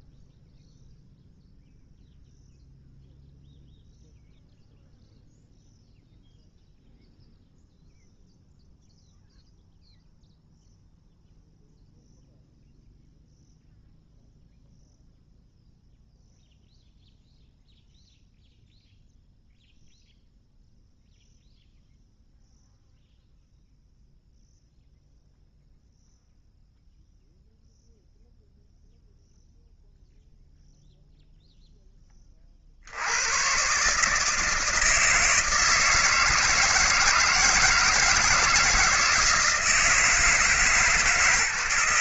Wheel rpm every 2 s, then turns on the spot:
0, 0, 0, 0, 0, 0, 0, 0, 0, 0, 0, 0, 0, 0, 0, 0, 20, 160, 160, 160, 160.
none